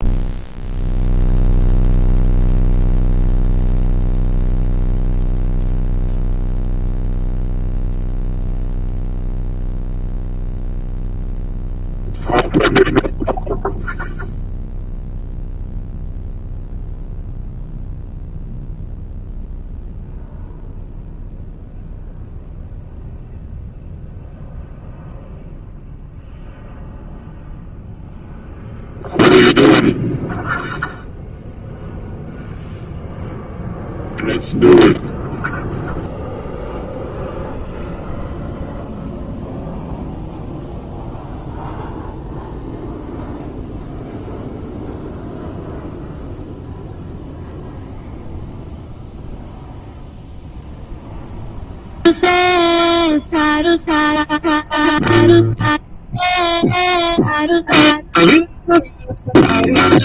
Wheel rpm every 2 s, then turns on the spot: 0, 0, 0, 0, 0, 0, 0, 0, 0, 0, 0, 0, 0, 0, 0, 0, 0, 0, 0, 0, 0, 0, 0, 0, 0, 0, 0, 0, 0, 0.
none